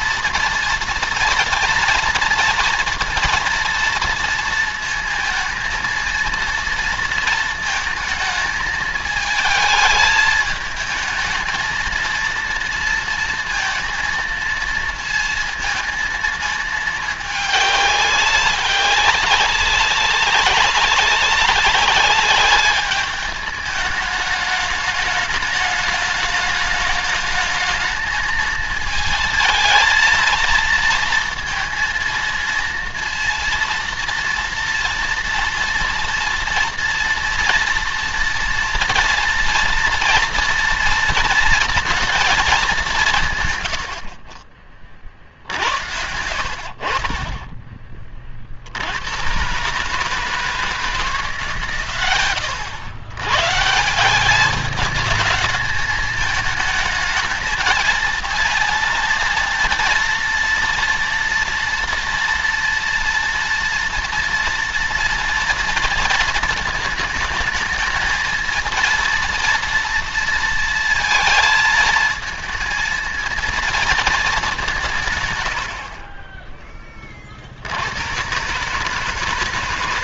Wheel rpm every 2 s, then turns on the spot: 230, 230, 230, 230, 220, 220, 230, 230, 220, 200, 190, 200, 210, 210, 220, 230, 230, 230, 230, 230, 230, 220, 60, 80, 40, 150, 110, 190, 220, 220, 230, 230, 240, 230, 220, 230, 220, 210, 30, 120.
46-48